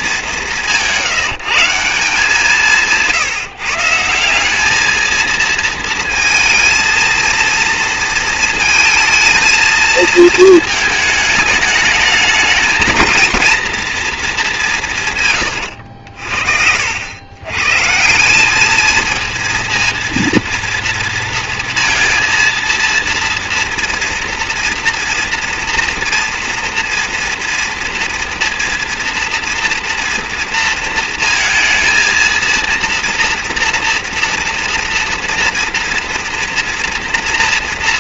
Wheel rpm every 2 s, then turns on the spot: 180, 170, 190, 230, 230, 220, 210, 200, 60, 200, 230, 230, 230, 230, 230, 230, 230, 230, 230.
16-18